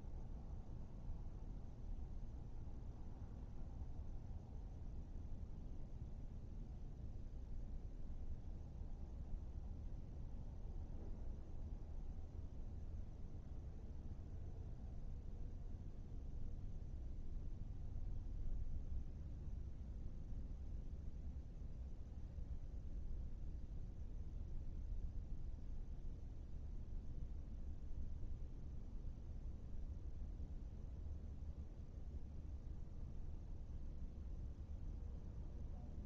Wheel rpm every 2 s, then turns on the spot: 0, 0, 0, 0, 0, 0, 0, 0, 0, 0, 0, 0, 0, 0, 0, 0, 0, 0.
none